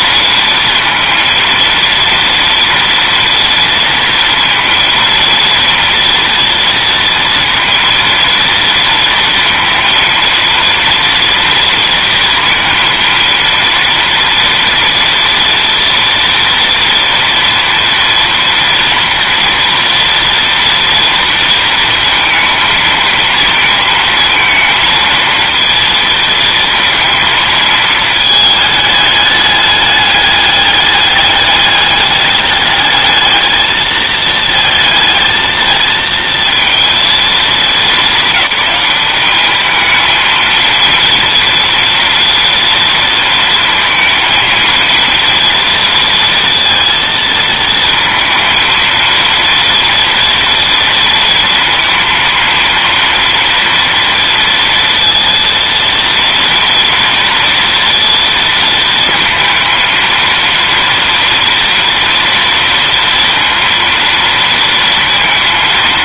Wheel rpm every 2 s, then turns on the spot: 230, 230, 230, 230, 230, 230, 230, 240, 230, 230, 230, 230, 230, 230, 220, 210, 210, 220, 230, 200, 230, 230, 230, 230, 230, 230, 230, 230, 230, 230, 230, 230, 230.
none